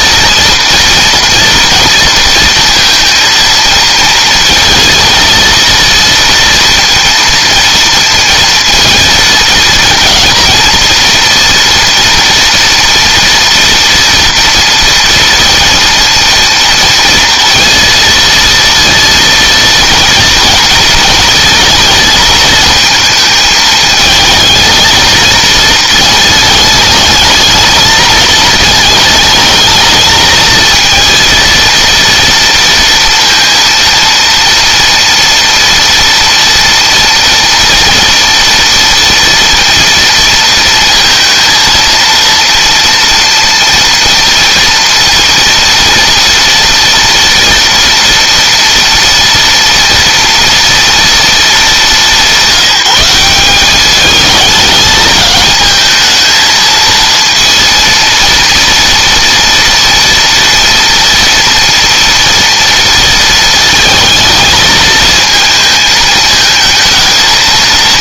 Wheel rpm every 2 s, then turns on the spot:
230, 230, 230, 230, 230, 230, 230, 230, 230, 230, 220, 230, 230, 210, 220, 230, 230, 230, 230, 230, 230, 230, 230, 230, 230, 230, 190, 220, 230, 230, 230, 230, 220, 230.
none